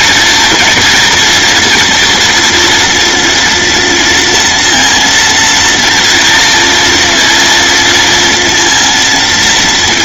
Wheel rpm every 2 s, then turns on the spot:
230, 240, 230, 230, 230.
none